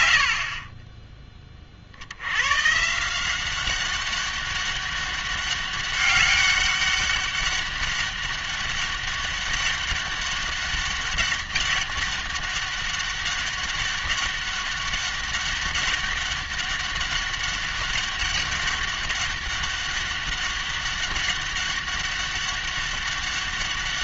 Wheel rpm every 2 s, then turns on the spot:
70, 130, 200, 200, 200, 200, 200, 200, 200, 200, 200, 200.
0-2